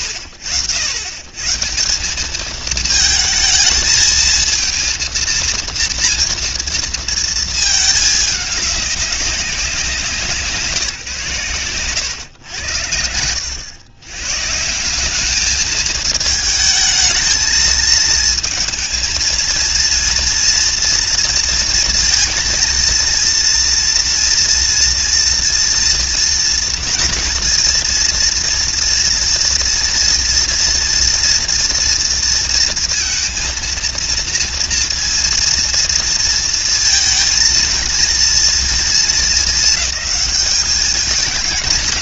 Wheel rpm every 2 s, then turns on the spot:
70, 200, 220, 230, 200, 180, 100, 140, 220, 220, 230, 230, 230, 230, 230, 230, 230, 230, 230, 230, 210.
none